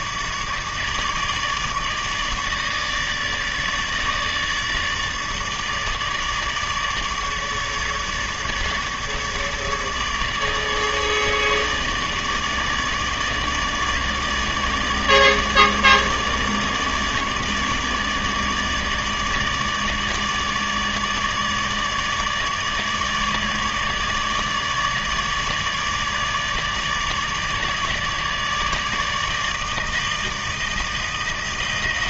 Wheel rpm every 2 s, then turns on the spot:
150, 150, 150, 150, 150, 150, 150, 150, 150, 150, 150, 150, 150, 150, 150, 160.
none